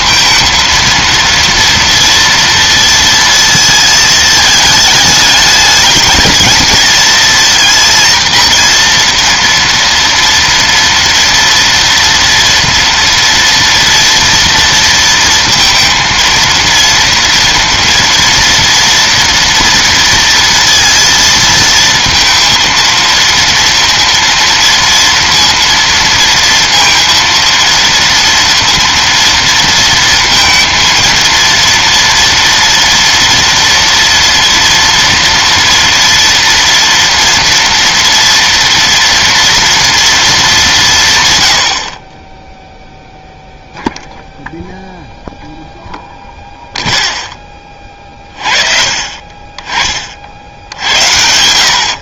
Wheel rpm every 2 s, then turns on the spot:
230, 230, 220, 220, 230, 230, 230, 230, 230, 230, 230, 230, 230, 230, 230, 230, 230, 230, 230, 230, 200, 10, 0, 0, 40, 70.
none